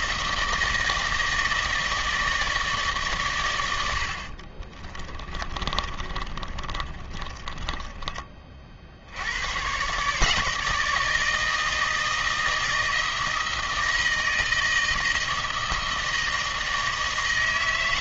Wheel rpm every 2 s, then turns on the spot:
160, 150, 30, 20, 40, 160, 160, 160, 160.
4-8